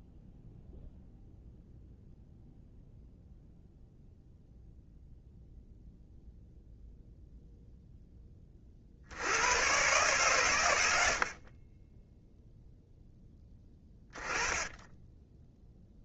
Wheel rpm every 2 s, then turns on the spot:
0, 0, 0, 0, 50, 90, 0, 20.
none